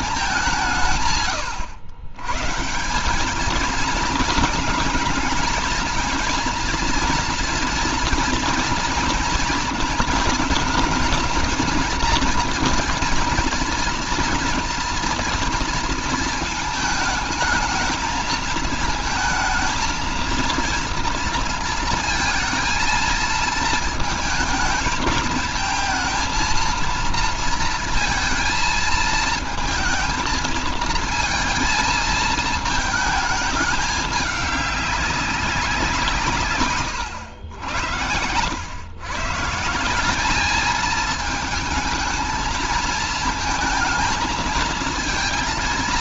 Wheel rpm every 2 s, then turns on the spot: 150, 170, 220, 240, 230, 230, 230, 230, 220, 220, 230, 220, 220, 230, 220, 230, 220, 200, 120, 120, 210, 220, 220.
none